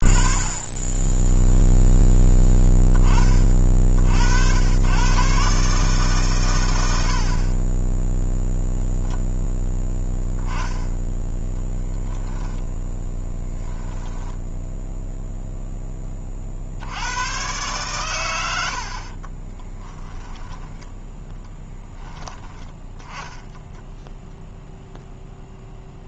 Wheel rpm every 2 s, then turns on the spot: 30, 10, 90, 110, 0, 0, 10, 0, 50, 90, 10, 10, 0.
0-2 20-22